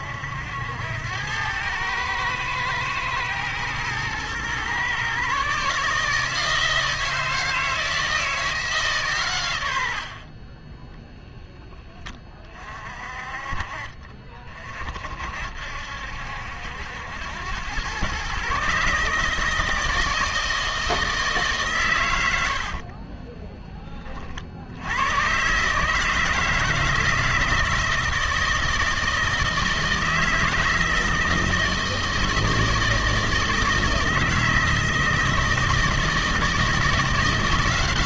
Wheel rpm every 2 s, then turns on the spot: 80, 110, 120, 160, 160, 30, 30, 40, 80, 140, 160, 60, 60, 160, 160, 160, 160, 160, 170.
22-24